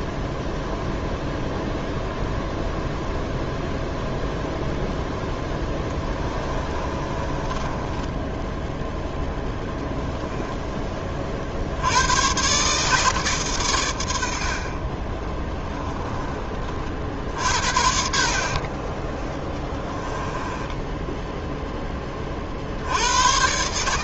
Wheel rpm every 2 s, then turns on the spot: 0, 0, 0, 20, 0, 20, 140, 50, 40, 30, 10, 60.
6-8 20-22